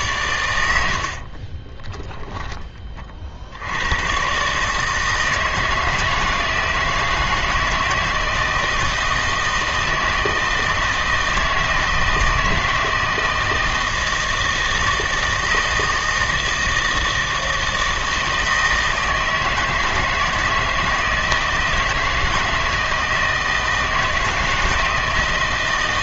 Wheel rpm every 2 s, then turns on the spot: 90, 20, 150, 160, 160, 160, 160, 160, 160, 160, 160, 160, 160.
none